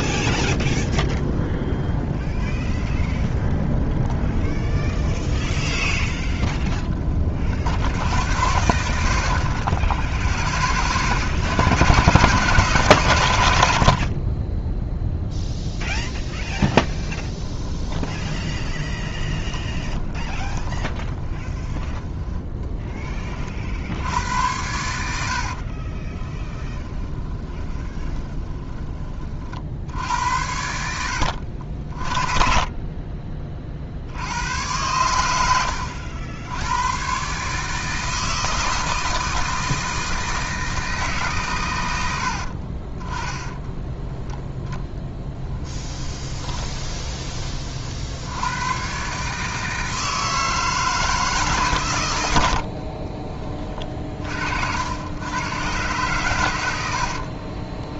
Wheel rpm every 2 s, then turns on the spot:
10, 20, 20, 20, 80, 30, 140, 10, 10, 30, 30, 10, 80, 10, 20, 80, 20, 100, 110, 160, 160, 40, 0, 20, 120, 160, 40, 80, 90.
2-6 8-10 16-22 26-30 42-44 46-48 52-54 56-58